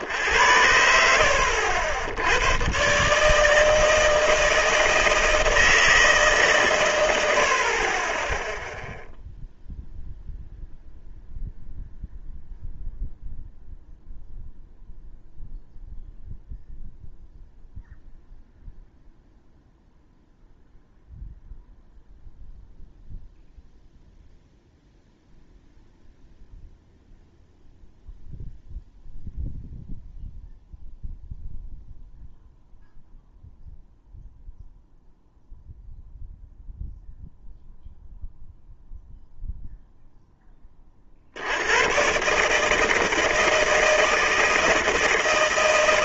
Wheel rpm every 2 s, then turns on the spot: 70, 120, 160, 130, 0, 0, 0, 0, 0, 0, 0, 0, 0, 0, 0, 0, 0, 0, 0, 0, 20, 150, 160.
none